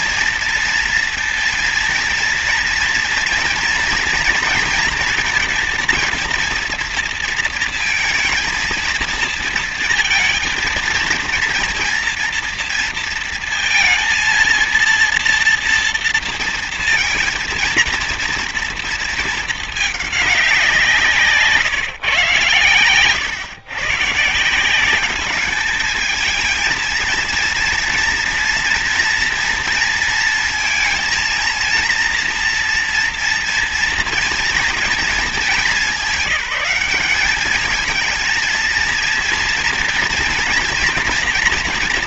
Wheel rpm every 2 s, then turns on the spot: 230, 230, 230, 230, 230, 230, 230, 230, 230, 230, 180, 120, 180, 230, 230, 230, 230, 230, 200, 230, 240.
none